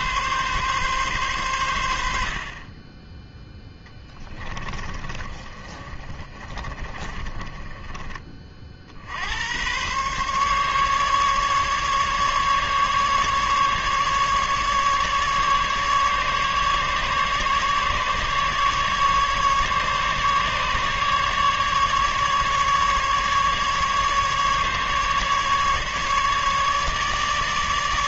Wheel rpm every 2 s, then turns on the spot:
130, 20, 30, 30, 50, 140, 140, 150, 140, 150, 150, 150, 140, 150.
4-8